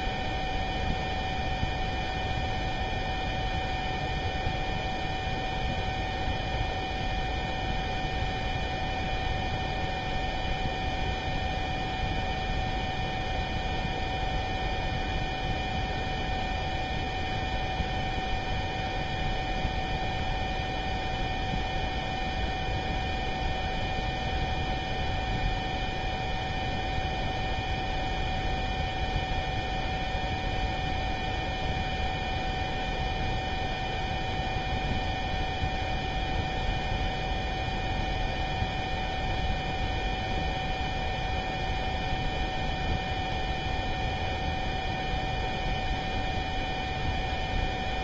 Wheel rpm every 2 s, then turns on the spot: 0, 0, 0, 0, 0, 0, 0, 0, 0, 0, 0, 0, 0, 0, 0, 0, 0, 0, 0, 0, 0, 0, 0, 0.
none